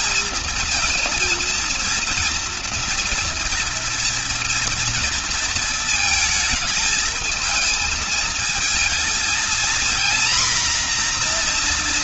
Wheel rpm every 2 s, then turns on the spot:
220, 230, 230, 220, 220, 250.
none